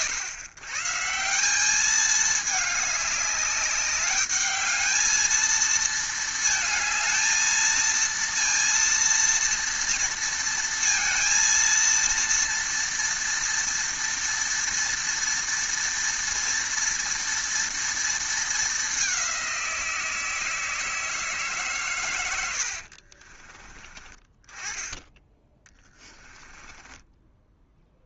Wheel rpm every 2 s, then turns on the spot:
130, 210, 220, 220, 230, 230, 230, 230, 230, 210, 160, 60, 10, 10.
22-24 26-28